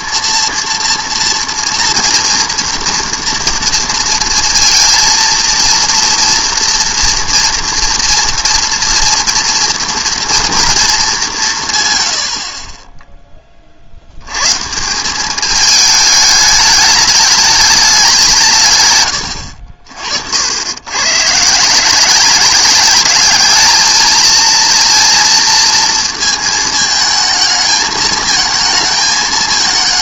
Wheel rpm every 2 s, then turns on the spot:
230, 230, 230, 230, 230, 230, 30, 140, 210, 130, 90, 190, 230, 220, 220.
none